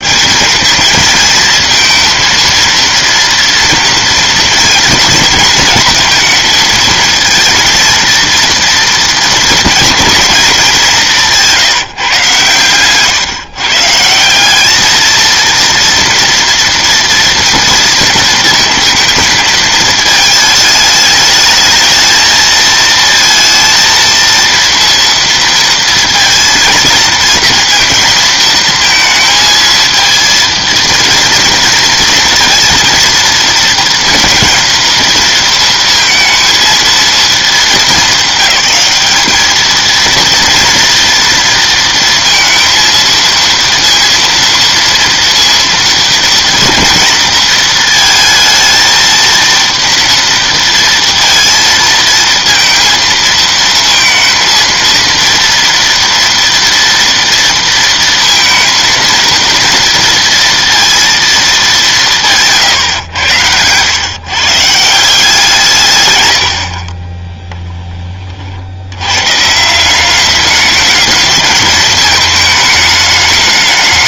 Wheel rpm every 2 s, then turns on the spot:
220, 230, 230, 230, 230, 200, 130, 210, 230, 220, 220, 230, 230, 230, 220, 230, 230, 230, 220, 200, 230, 230, 230, 230, 230, 230, 230, 230, 230, 230, 230, 130, 160, 50, 80, 210, 210.
62-64